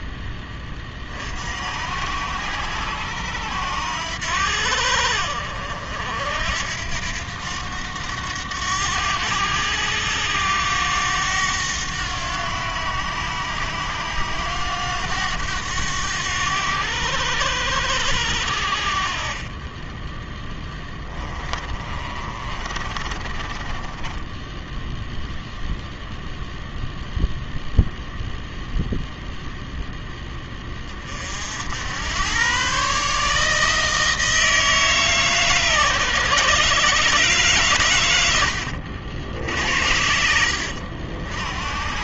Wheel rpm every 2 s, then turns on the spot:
20, 80, 70, 80, 100, 100, 90, 90, 90, 60, 10, 30, 0, 0, 0, 20, 130, 160, 140, 80, 60.
20-24